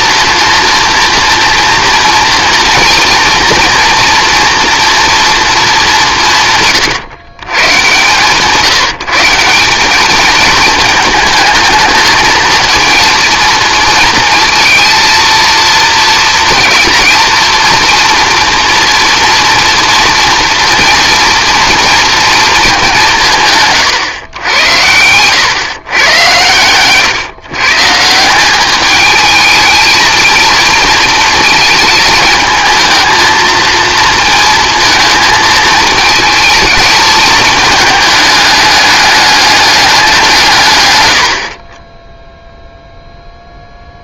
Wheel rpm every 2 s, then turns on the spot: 230, 240, 240, 150, 150, 220, 230, 230, 230, 230, 230, 210, 100, 120, 200, 230, 220, 230, 220, 210, 140, 0.
none